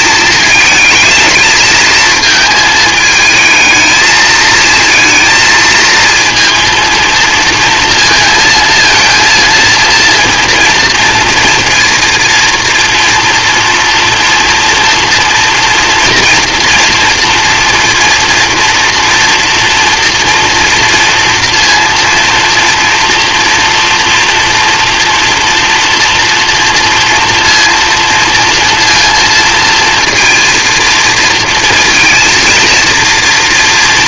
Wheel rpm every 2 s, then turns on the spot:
220, 220, 230, 230, 230, 230, 230, 230, 230, 230, 230, 230, 230, 230, 230, 230, 230.
none